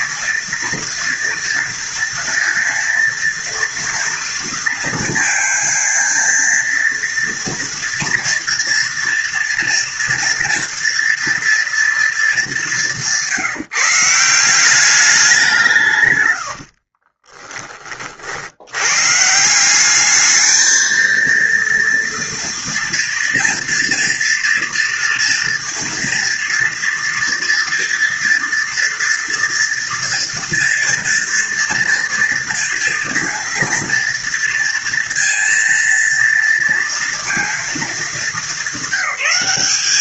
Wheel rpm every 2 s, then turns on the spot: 230, 230, 230, 230, 230, 240, 180, 190, 40, 120, 220, 240, 230, 230, 240, 230, 230, 230, 230, 190.
16-18